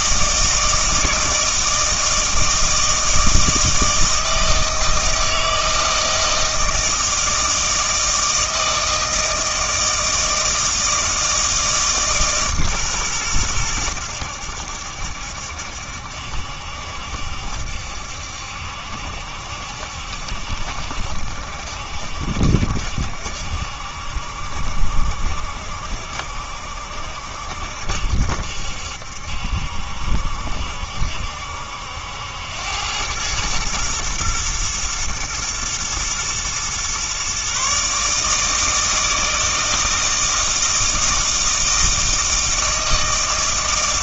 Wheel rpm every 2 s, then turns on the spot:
160, 160, 160, 160, 160, 160, 140, 80, 70, 70, 70, 70, 70, 70, 70, 70, 90, 110, 120, 160, 160, 160.
none